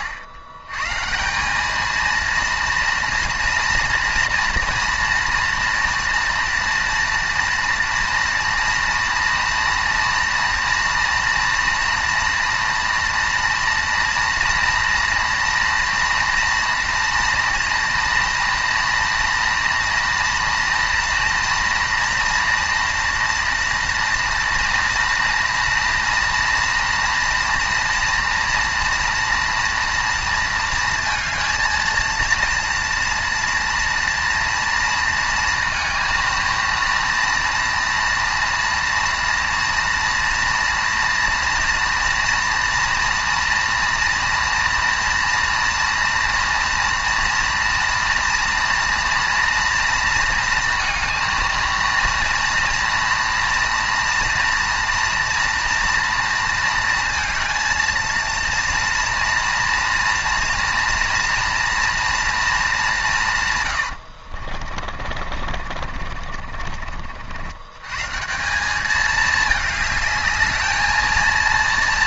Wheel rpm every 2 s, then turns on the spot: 110, 230, 230, 230, 230, 230, 230, 230, 230, 230, 230, 230, 230, 230, 230, 220, 230, 230, 230, 230, 230, 230, 230, 230, 230, 230, 240, 240, 230, 230, 240, 200, 40, 50, 200, 220.
64-68